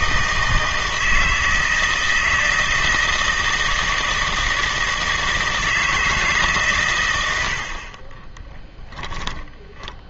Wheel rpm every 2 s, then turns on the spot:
160, 160, 160, 130, 10.
8-10